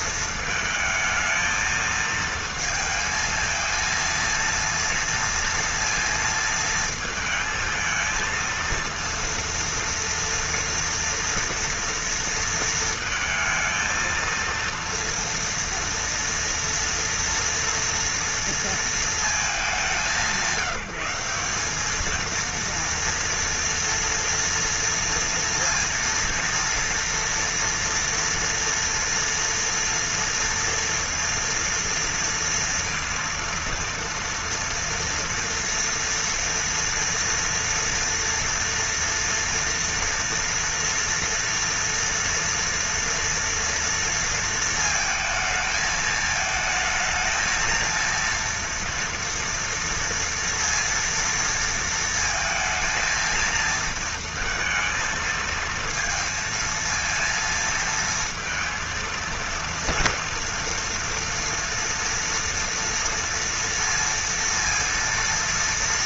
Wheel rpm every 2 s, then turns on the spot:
220, 220, 230, 220, 230, 230, 230, 230, 230, 230, 190, 230, 230, 230, 230, 230, 230, 240, 230, 240, 230, 230, 230, 220, 230, 230, 230, 230, 230, 230, 230, 230, 230.
none